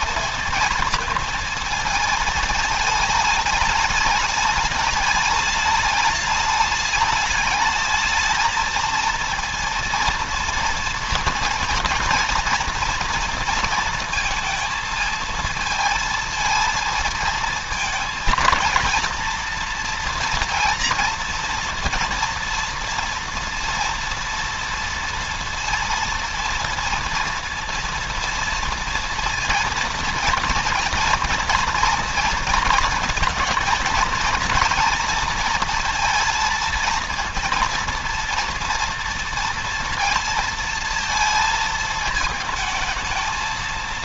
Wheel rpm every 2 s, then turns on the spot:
230, 220, 210, 210, 220, 230, 230, 220, 220, 220, 240, 230, 230, 230, 230, 240, 230, 230, 230, 230, 230, 220.
none